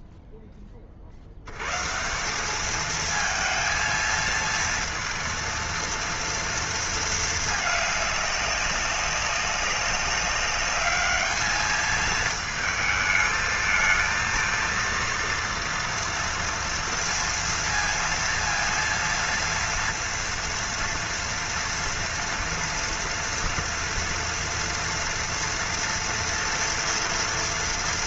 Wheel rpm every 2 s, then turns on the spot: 10, 200, 230, 230, 200, 200, 220, 230, 230, 230, 230, 230, 230, 230.
none